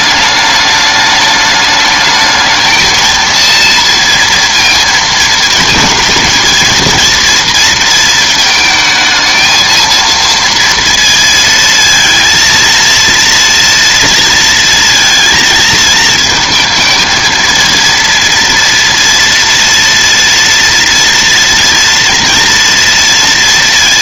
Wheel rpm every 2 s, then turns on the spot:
210, 220, 230, 220, 220, 230, 230, 230, 230, 230, 230, 230.
none